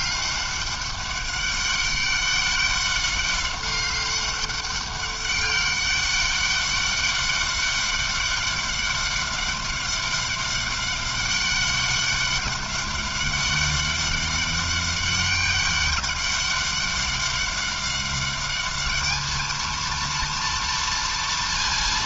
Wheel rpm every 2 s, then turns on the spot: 200, 200, 200, 200, 200, 200, 200, 200, 200, 200, 230.
none